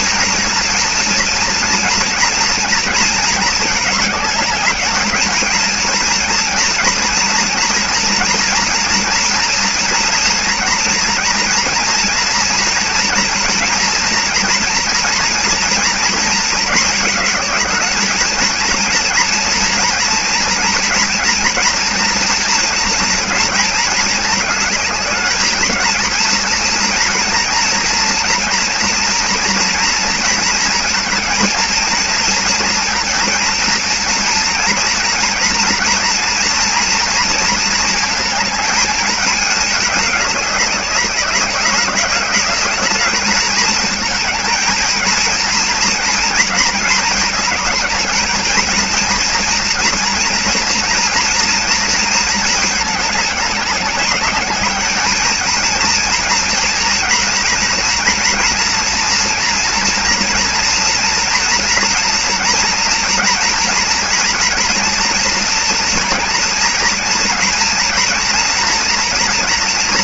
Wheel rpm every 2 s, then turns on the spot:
230, 230, 210, 230, 230, 230, 230, 230, 230, 230, 230, 230, 220, 230, 230, 230, 230, 230, 230, 230, 210, 200, 220, 230, 220, 240, 220, 200, 230, 230, 230, 240, 240, 230, 230.
none